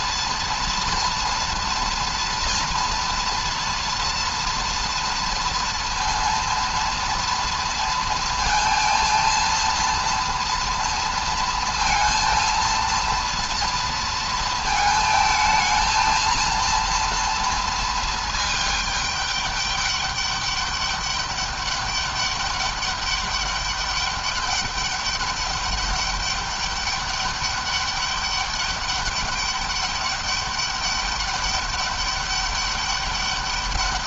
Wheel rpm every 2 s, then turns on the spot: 230, 230, 230, 230, 230, 230, 230, 230, 230, 220, 200, 200, 200, 200, 200, 200, 200.
none